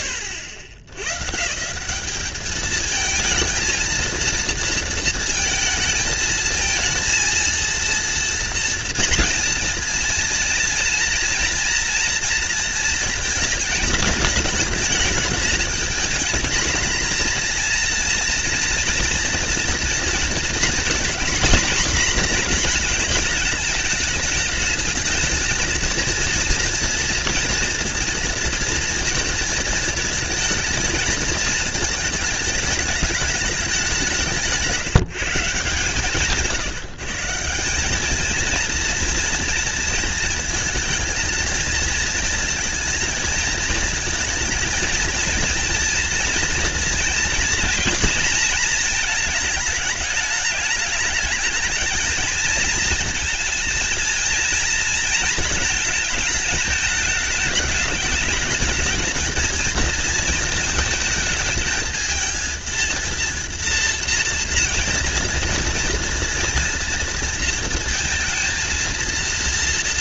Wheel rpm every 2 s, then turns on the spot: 130, 220, 230, 230, 230, 230, 230, 210, 230, 230, 240, 230, 220, 230, 230, 230, 210, 170, 160, 230, 230, 220, 230, 230, 230, 210, 230, 230, 210, 220, 220, 230, 230, 230, 230.
none